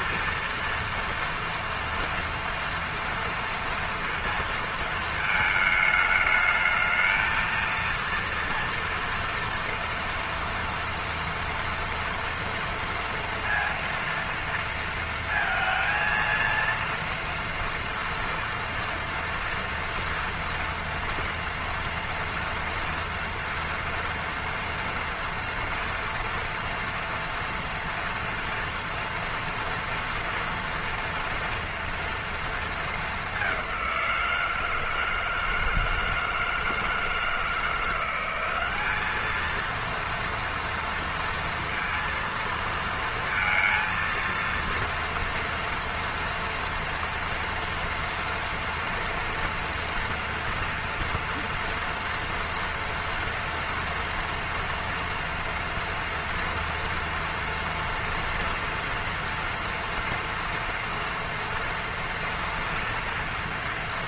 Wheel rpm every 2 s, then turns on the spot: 230, 230, 230, 220, 230, 230, 240, 230, 230, 230, 230, 230, 230, 230, 230, 230, 230, 170, 160, 180, 230, 230, 230, 230, 230, 230, 230, 230, 230, 230, 230, 230.
none